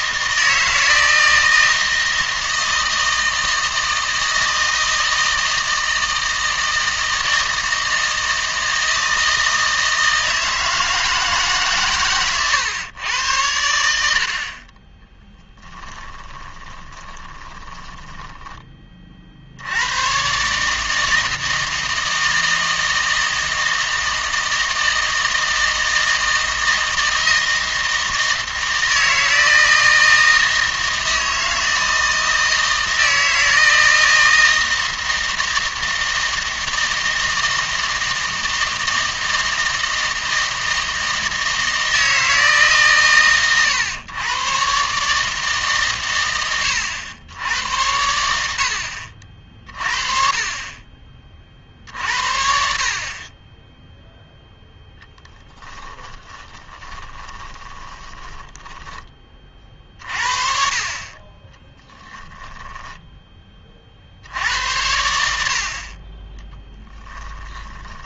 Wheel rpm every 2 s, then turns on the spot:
160, 160, 160, 160, 160, 160, 120, 20, 10, 10, 150, 160, 160, 160, 160, 160, 160, 160, 160, 160, 160, 140, 130, 90, 70, 30, 50, 0, 20, 10, 40, 10, 80, 10.
16-18 56-60 62-64 66-68